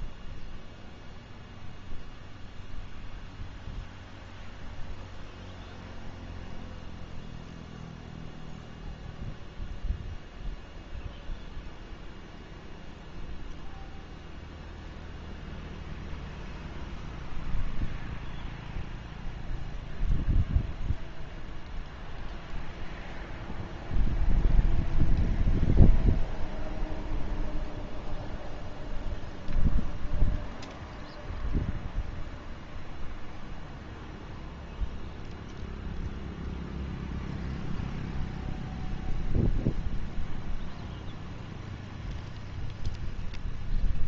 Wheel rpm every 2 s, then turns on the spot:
0, 0, 0, 0, 0, 0, 0, 0, 0, 0, 0, 0, 0, 0, 0, 0, 0, 0, 0, 0, 0, 0.
none